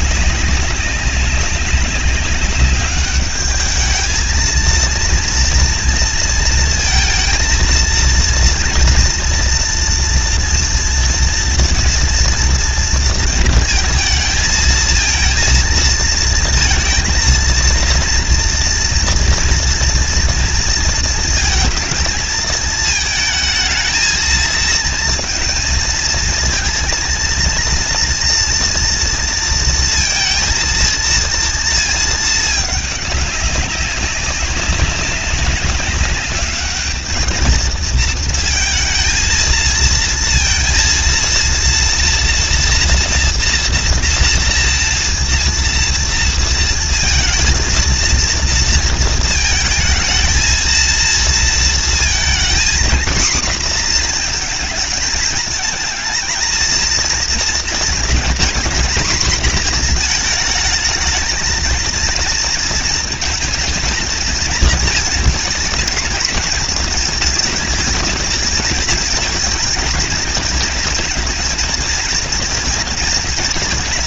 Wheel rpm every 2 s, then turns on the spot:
200, 200, 230, 230, 230, 230, 240, 220, 230, 230, 230, 220, 230, 230, 230, 230, 210, 190, 210, 230, 230, 240, 230, 230, 230, 220, 230, 230, 220, 230, 220, 230, 230, 230, 220, 230, 230.
none